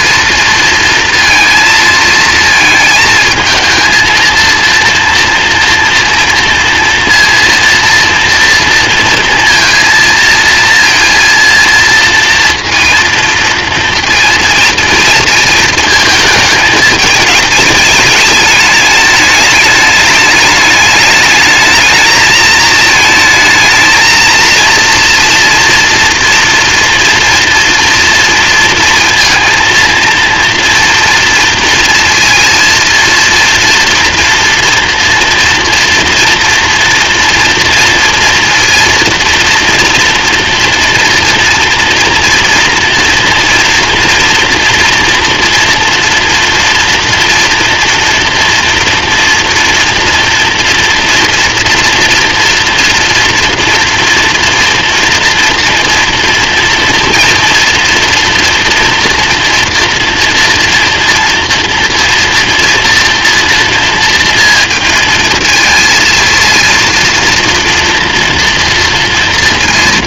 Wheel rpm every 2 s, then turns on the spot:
230, 220, 230, 230, 230, 230, 230, 220, 210, 210, 210, 220, 230, 230, 230, 230, 230, 230, 240, 230, 230, 230, 230, 240, 230, 230, 230, 230, 240, 240, 230, 240, 230, 230, 230.
none